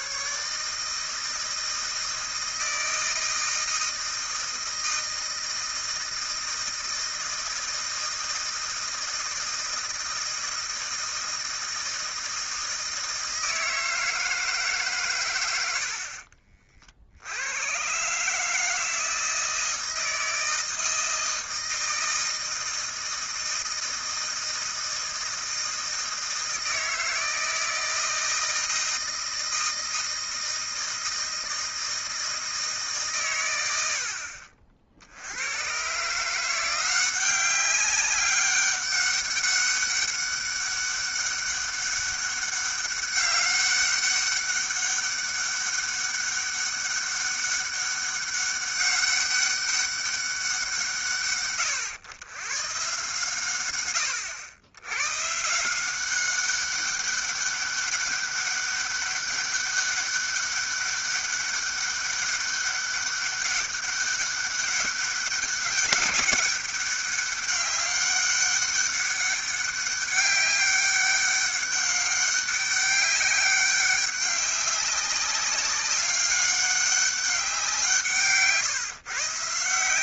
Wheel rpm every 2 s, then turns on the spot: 140, 160, 160, 160, 160, 160, 160, 150, 40, 150, 160, 160, 160, 160, 160, 160, 160, 50, 170, 200, 200, 200, 200, 200, 200, 180, 120, 90, 190, 200, 200, 200, 200, 200, 200, 200, 200, 200, 200, 140.
none